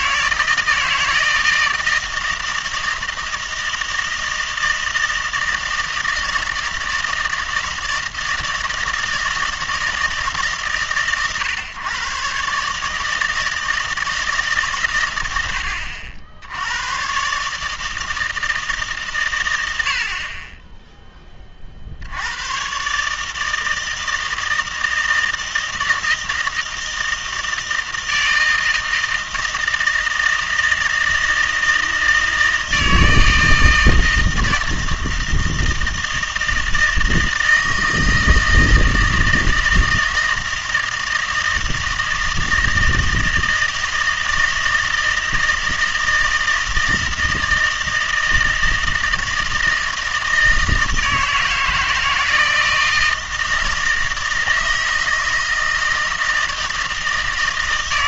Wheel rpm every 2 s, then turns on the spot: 160, 160, 160, 160, 160, 140, 150, 140, 90, 150, 10, 120, 160, 160, 160, 160, 160, 160, 160, 160, 160, 160, 160, 160, 160, 160, 160, 160, 160.
none